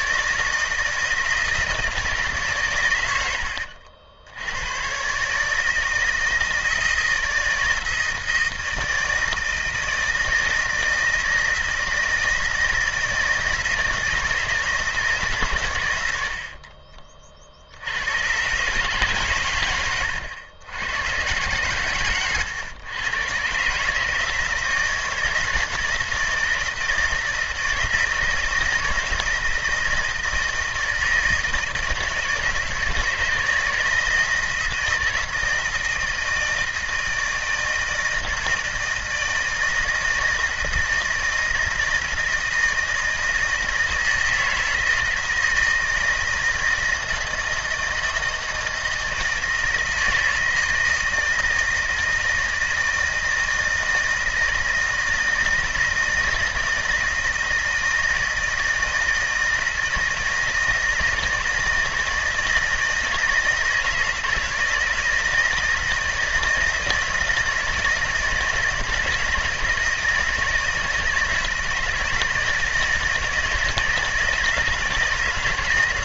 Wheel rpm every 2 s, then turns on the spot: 160, 110, 120, 160, 160, 160, 160, 160, 40, 140, 120, 120, 160, 160, 160, 160, 160, 160, 160, 160, 160, 160, 160, 160, 160, 160, 160, 160, 160, 160, 160, 160, 160, 160, 160, 160, 160, 160.
16-18